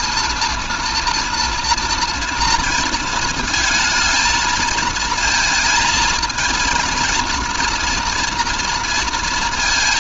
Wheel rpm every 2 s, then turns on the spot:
240, 230, 220, 230, 230.
none